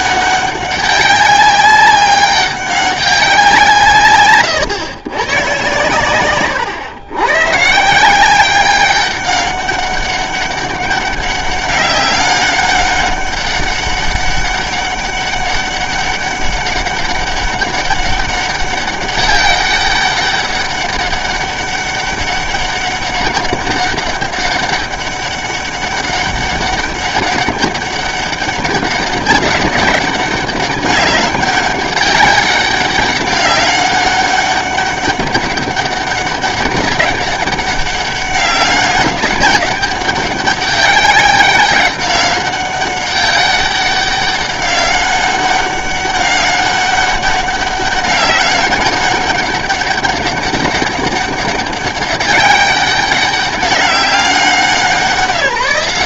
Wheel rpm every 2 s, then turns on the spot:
200, 200, 120, 120, 190, 200, 200, 200, 200, 200, 200, 200, 200, 200, 200, 200, 190, 200, 200, 200, 190, 200, 190, 200, 200, 190, 200, 180.
4-6